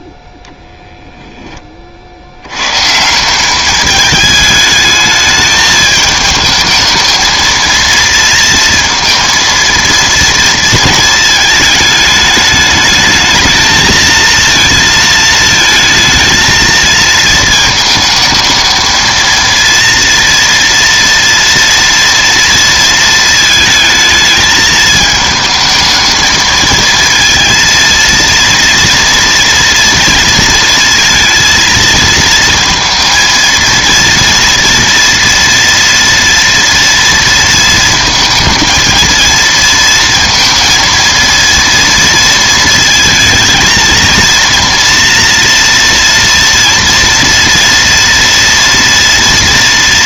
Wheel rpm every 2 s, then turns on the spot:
0, 100, 220, 220, 230, 230, 210, 230, 230, 220, 230, 230, 220, 220, 230, 230, 230, 230, 230, 220, 230, 230, 230, 230, 230.
none